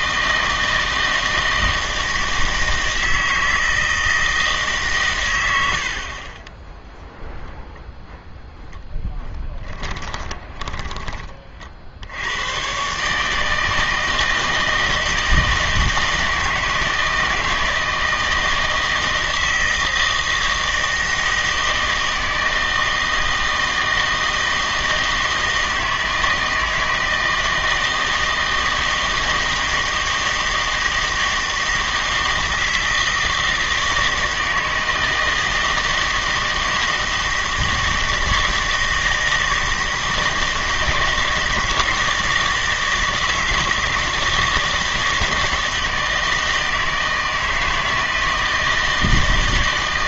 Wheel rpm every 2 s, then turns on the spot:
160, 160, 150, 10, 10, 20, 130, 160, 160, 160, 160, 160, 160, 160, 160, 160, 160, 160, 160, 160, 160, 160, 160, 160, 160.
10-12